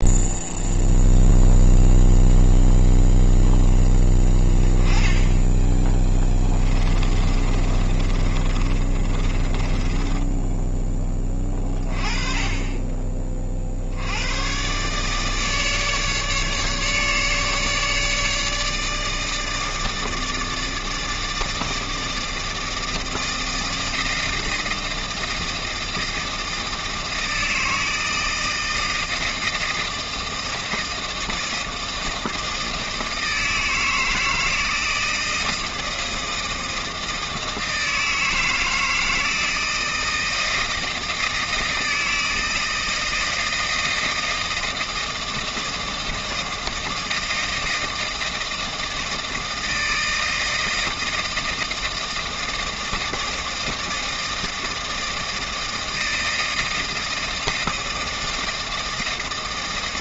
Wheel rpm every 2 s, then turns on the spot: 0, 0, 10, 20, 30, 10, 20, 130, 150, 150, 160, 160, 160, 160, 160, 160, 160, 160, 160, 160, 160, 160, 160, 160, 160, 160, 160, 160, 160, 160.
6-10